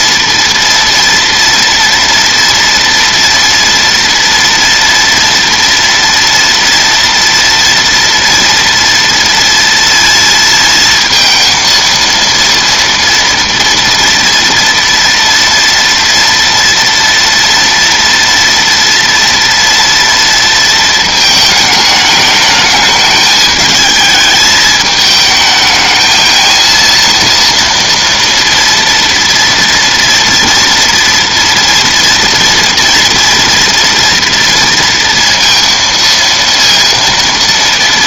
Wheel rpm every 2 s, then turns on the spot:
230, 230, 230, 230, 230, 230, 230, 230, 230, 230, 220, 210, 220, 230, 230, 240, 230, 230, 230.
none